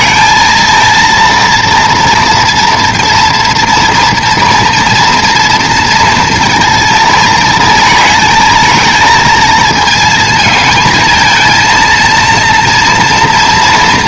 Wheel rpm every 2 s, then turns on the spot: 230, 230, 230, 230, 220, 220, 230.
none